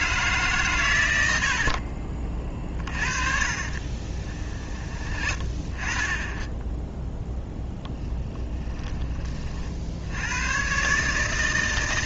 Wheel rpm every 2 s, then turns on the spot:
140, 40, 30, 10, 10, 120.
2-4 8-10